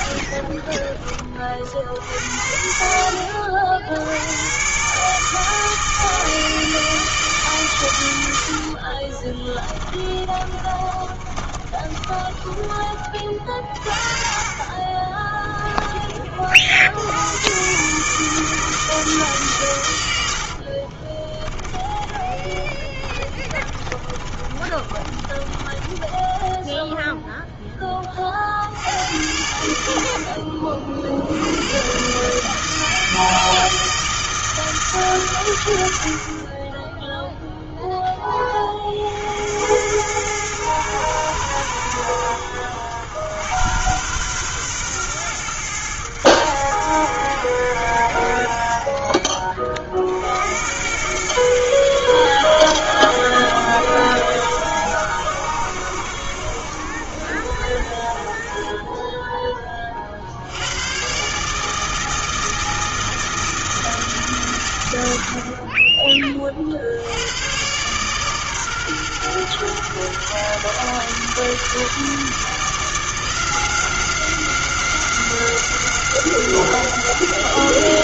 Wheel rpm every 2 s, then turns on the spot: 20, 70, 140, 160, 40, 20, 30, 30, 70, 160, 50, 30, 30, 10, 80, 60, 160, 150, 10, 50, 110, 90, 120, 90, 30, 100, 90, 90, 70, 20, 110, 160, 100, 70, 130, 140, 160, 190, 190.
0-2 8-12 14-16 20-28